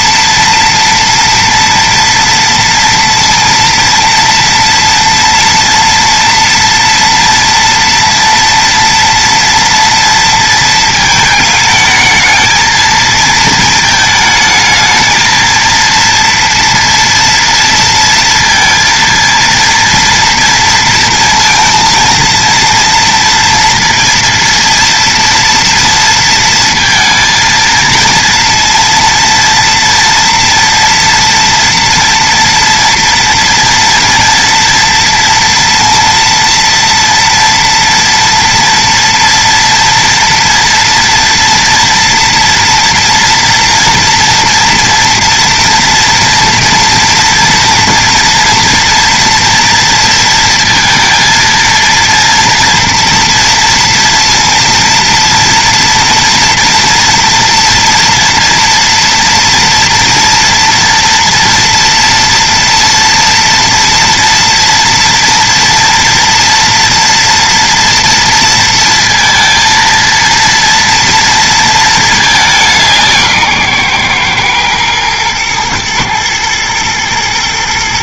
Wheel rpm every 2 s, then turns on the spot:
230, 230, 230, 240, 230, 220, 220, 220, 230, 230, 230, 230, 230, 230, 230, 230, 230, 230, 230, 230, 230, 230, 240, 240, 230, 230, 230, 230, 230, 230, 230, 230, 230, 230, 230, 230, 170, 120, 110.
none